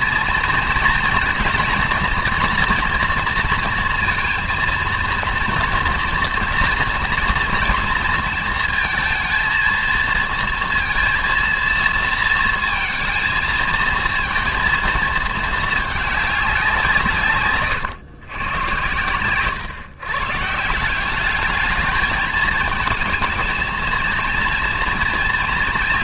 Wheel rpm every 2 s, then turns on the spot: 230, 240, 230, 230, 230, 230, 220, 230, 190, 110, 170, 230, 230.
none